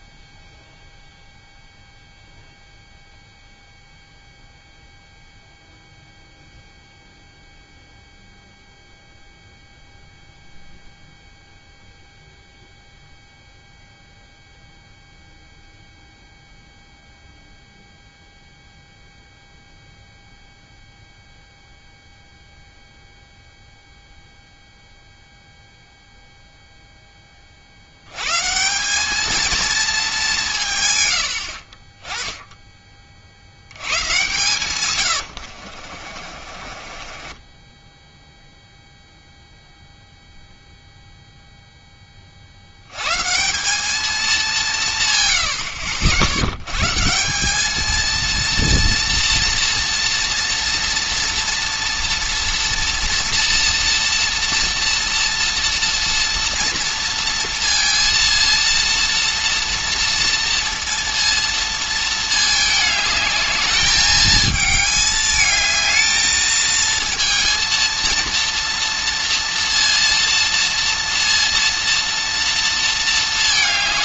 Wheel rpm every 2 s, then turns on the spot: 0, 0, 0, 0, 0, 0, 0, 0, 0, 0, 0, 0, 0, 0, 180, 150, 20, 120, 30, 0, 0, 100, 160, 110, 230, 230, 240, 230, 230, 230, 230, 220, 220, 220, 230, 230, 230.
36-38